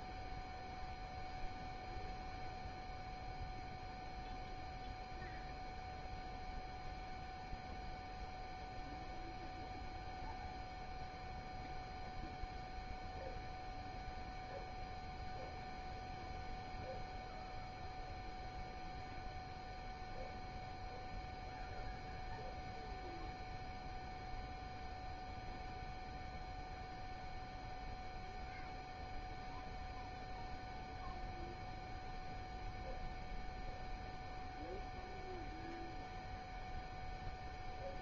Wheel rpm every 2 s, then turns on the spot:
0, 0, 0, 0, 0, 0, 0, 0, 0, 0, 0, 0, 0, 0, 0, 0, 0, 0, 0.
none